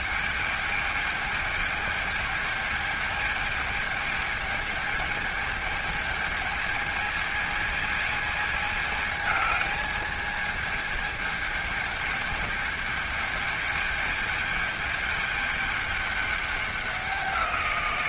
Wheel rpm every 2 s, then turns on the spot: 210, 210, 210, 220, 210, 210, 210, 210, 190.
none